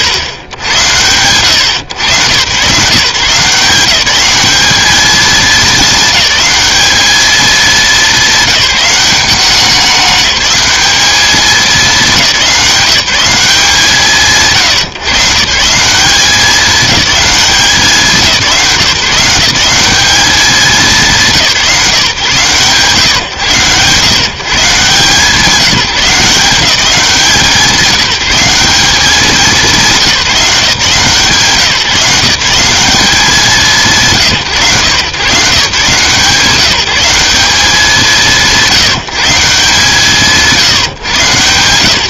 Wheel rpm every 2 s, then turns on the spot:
80, 140, 210, 210, 200, 210, 170, 140, 210, 160, 190, 140, 150, 180, 190, 150, 180, 120, 180, 160, 140.
none